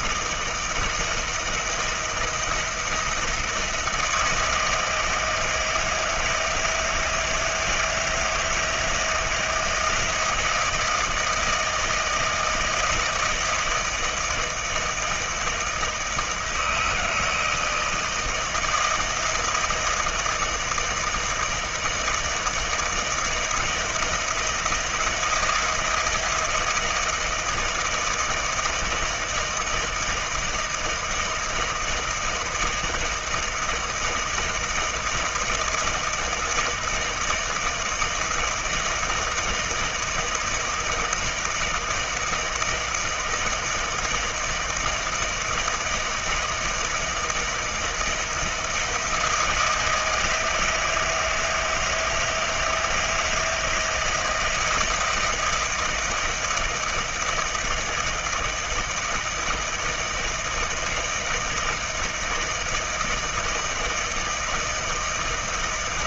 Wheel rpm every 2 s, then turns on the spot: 160, 170, 160, 160, 160, 160, 160, 160, 160, 160, 160, 160, 170, 160, 160, 160, 160, 160, 160, 160, 160, 160, 160, 170, 170, 160, 160, 160, 160, 160, 160, 160, 160.
none